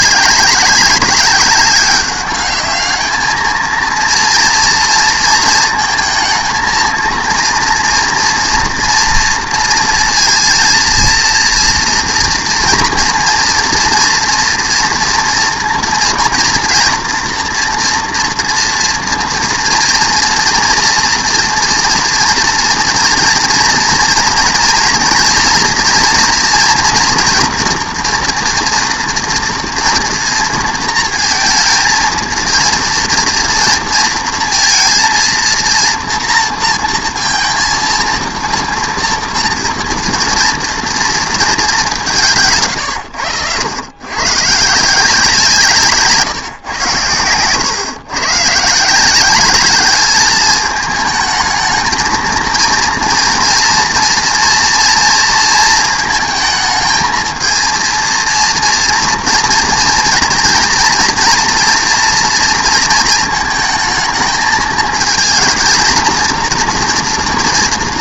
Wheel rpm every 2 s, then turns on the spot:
190, 210, 230, 230, 230, 230, 230, 230, 240, 230, 230, 230, 230, 240, 230, 230, 230, 230, 230, 230, 230, 130, 150, 120, 150, 220, 230, 230, 220, 230, 230, 230, 220, 240.
none